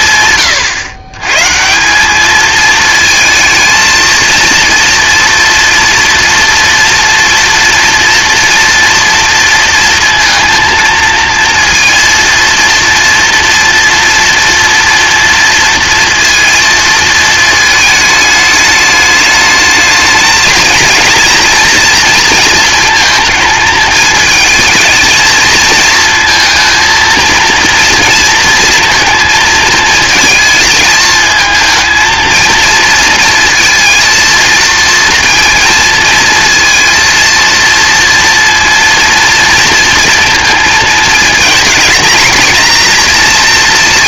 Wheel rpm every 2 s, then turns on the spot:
110, 220, 230, 230, 230, 230, 230, 230, 220, 210, 240, 220, 230, 230, 230, 220, 230, 230, 230, 230, 230, 230.
none